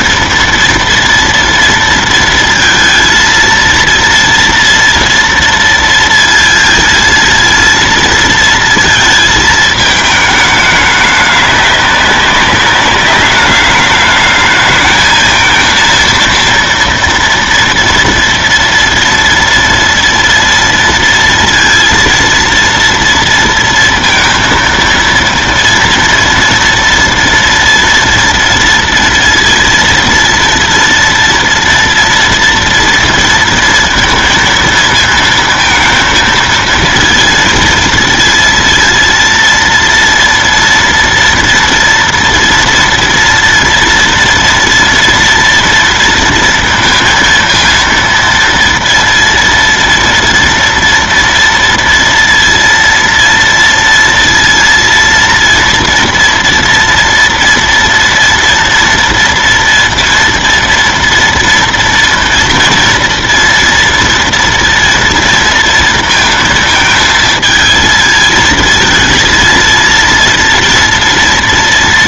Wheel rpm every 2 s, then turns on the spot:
230, 230, 230, 230, 230, 220, 200, 210, 230, 230, 230, 230, 230, 230, 230, 230, 230, 230, 230, 230, 230, 230, 240, 230, 230, 240, 230, 230, 240, 240, 240, 230, 230, 230, 230, 230.
none